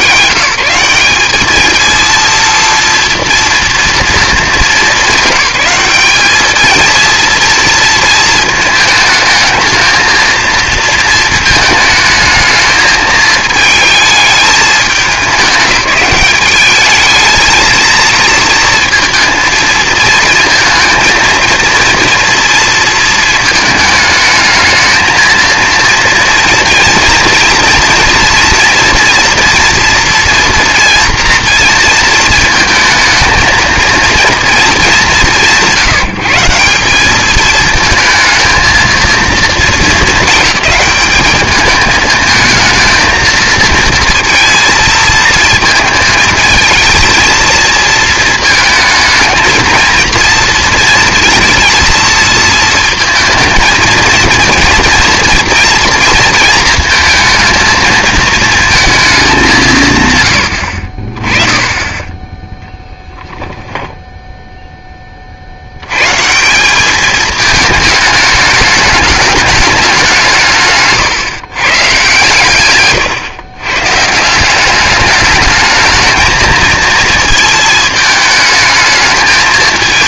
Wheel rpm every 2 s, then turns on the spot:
180, 230, 200, 220, 220, 220, 220, 210, 210, 230, 220, 230, 220, 230, 230, 230, 220, 210, 180, 230, 210, 220, 230, 220, 220, 230, 230, 230, 230, 220, 70, 10, 10, 190, 210, 150, 130, 200, 230, 220.
70-74